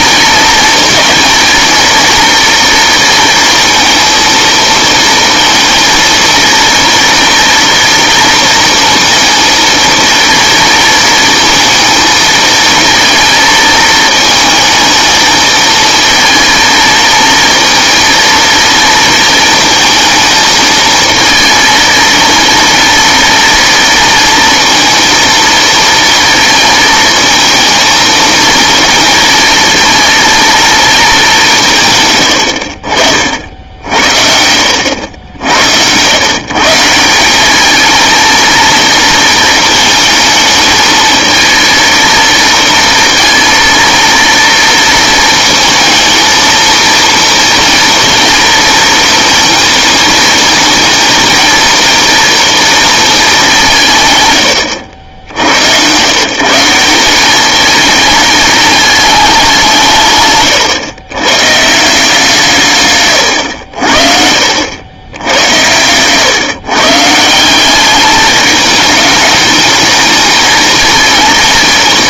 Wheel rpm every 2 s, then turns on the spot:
220, 230, 230, 230, 230, 220, 220, 220, 220, 230, 220, 230, 230, 230, 230, 230, 80, 80, 160, 240, 220, 230, 230, 230, 230, 220, 230, 90, 170, 210, 120, 140, 90, 140, 210, 220.
32-34 60-62